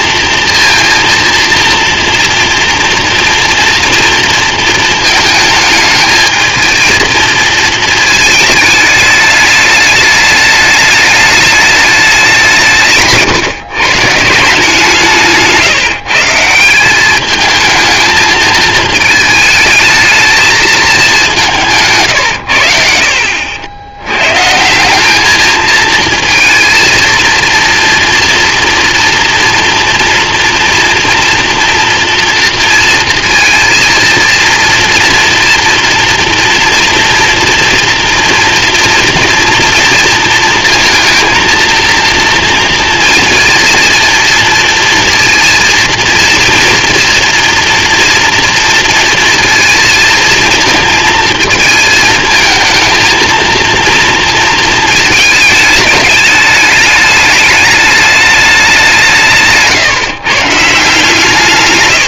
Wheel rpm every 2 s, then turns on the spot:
230, 230, 220, 220, 210, 210, 170, 160, 180, 220, 210, 80, 170, 230, 230, 240, 230, 230, 230, 230, 230, 230, 230, 240, 230, 220, 220, 230, 210, 190, 160.
none